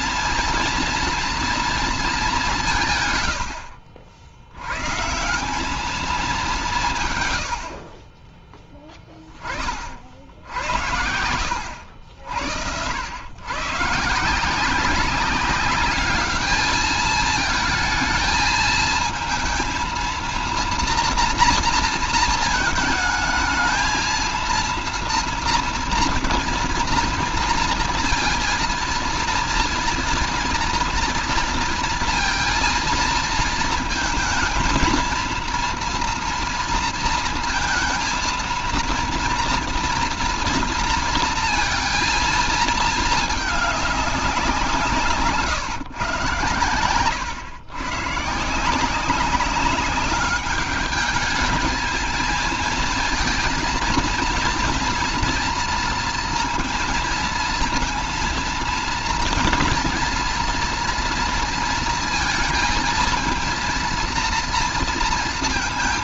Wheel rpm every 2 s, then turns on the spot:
230, 200, 90, 190, 20, 70, 80, 170, 210, 220, 230, 230, 230, 240, 230, 240, 230, 230, 230, 230, 240, 230, 190, 120, 160, 200, 220, 220, 230, 230, 230, 230, 230.
none